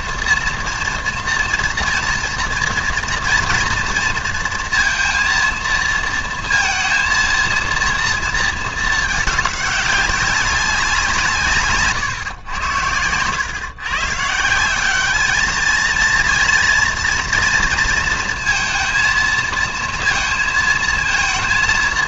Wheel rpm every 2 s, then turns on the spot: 230, 230, 230, 230, 230, 190, 100, 170, 230, 230, 230.
none